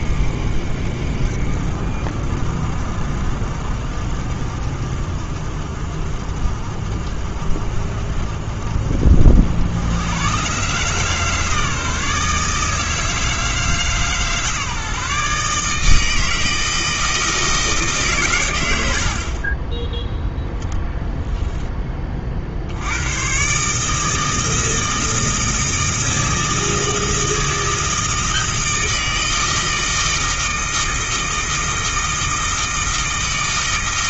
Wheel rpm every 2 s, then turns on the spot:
50, 50, 40, 50, 40, 140, 160, 150, 160, 70, 10, 80, 160, 160, 160, 160, 160.
none